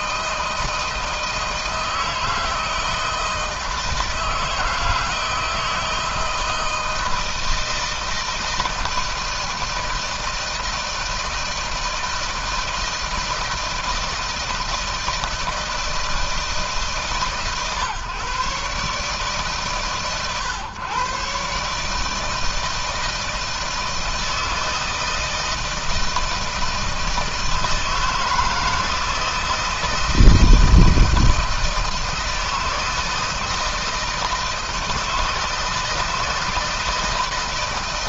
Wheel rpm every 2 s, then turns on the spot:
160, 160, 160, 160, 160, 160, 160, 160, 160, 150, 130, 160, 160, 160, 160, 160, 160, 160, 160.
none